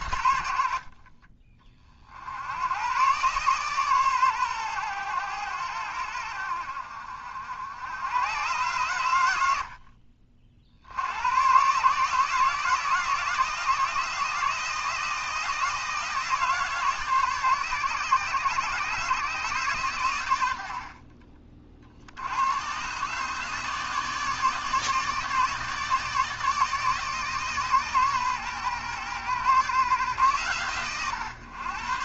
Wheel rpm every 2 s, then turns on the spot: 60, 100, 120, 70, 110, 60, 160, 160, 150, 130, 70, 120, 150, 150, 120, 120.
none